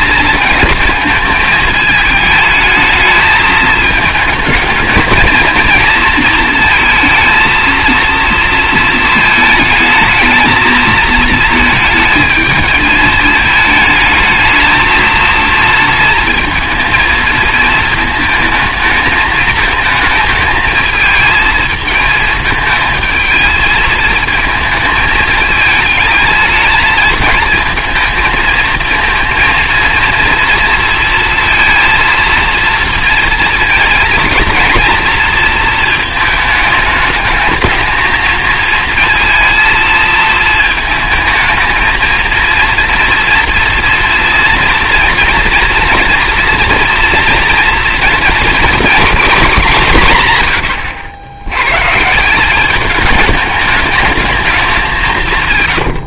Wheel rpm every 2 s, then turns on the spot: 220, 220, 220, 230, 230, 220, 220, 220, 230, 220, 220, 220, 220, 220, 220, 230, 230, 230, 220, 220, 220, 230, 230, 240, 230, 100, 200, 200.
none